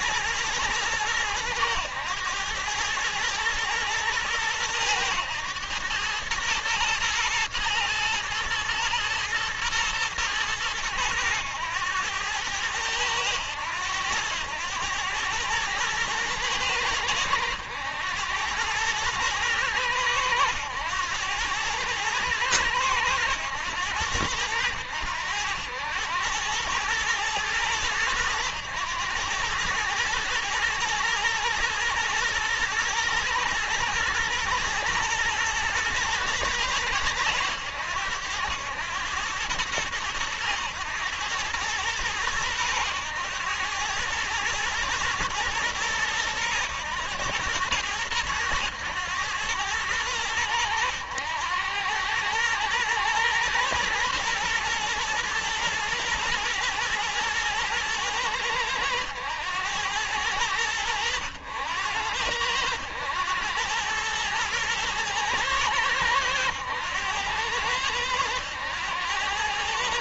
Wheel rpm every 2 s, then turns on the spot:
110, 110, 110, 110, 110, 110, 100, 100, 100, 100, 100, 110, 90, 110, 110, 110, 120, 110, 110, 100, 100, 100, 110, 110, 100, 100, 110, 120, 110, 100, 100, 90, 120, 100, 100.
none